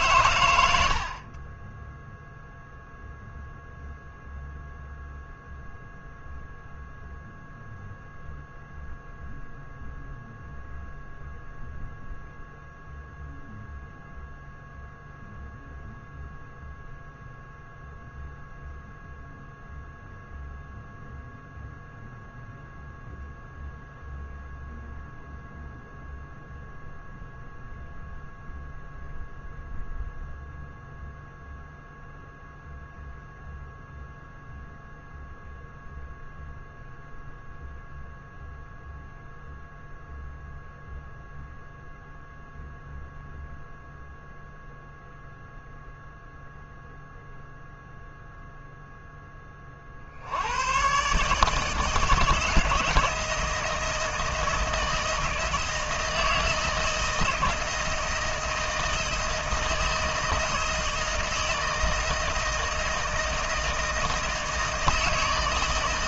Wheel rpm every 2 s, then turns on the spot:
100, 0, 0, 0, 0, 0, 0, 0, 0, 0, 0, 0, 0, 0, 0, 0, 0, 0, 0, 0, 0, 0, 0, 0, 0, 100, 160, 160, 160, 160, 160, 160, 160.
none